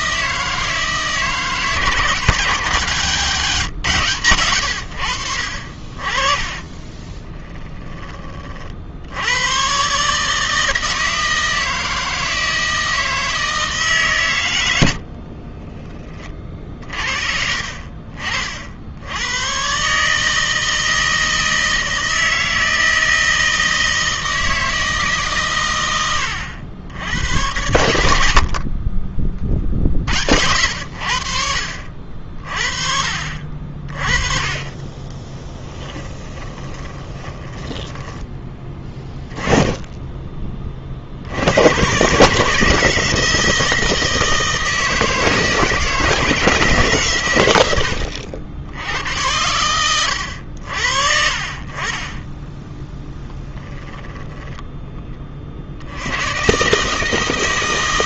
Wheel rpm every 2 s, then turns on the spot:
160, 170, 90, 30, 60, 160, 160, 70, 40, 70, 160, 160, 160, 90, 40, 80, 50, 20, 20, 20, 40, 160, 160, 150, 90, 60, 10, 20, 150.
6-8 34-38 52-54